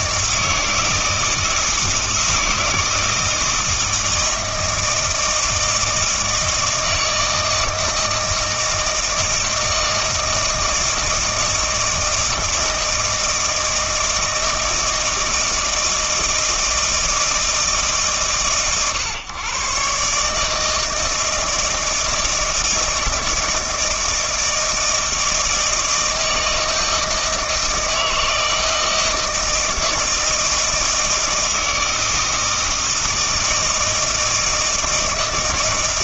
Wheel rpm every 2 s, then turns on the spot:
160, 160, 160, 160, 160, 160, 160, 160, 160, 130, 150, 160, 160, 160, 160, 160, 160, 160.
none